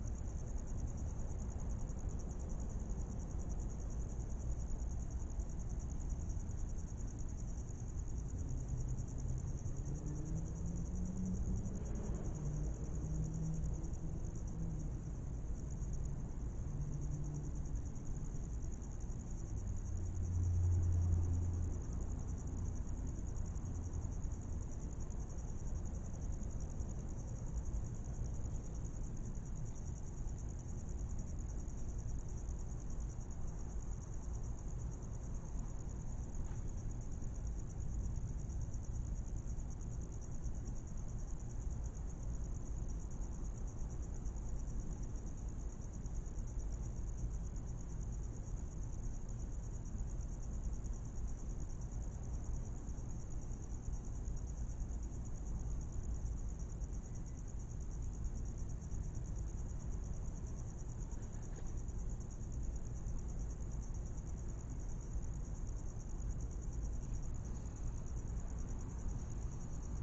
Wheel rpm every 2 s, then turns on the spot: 0, 0, 0, 0, 0, 0, 0, 0, 0, 0, 0, 0, 0, 0, 0, 0, 0, 0, 0, 0, 0, 0, 0, 0, 0, 0, 0, 0, 0, 0, 0, 0, 0, 0, 0.
none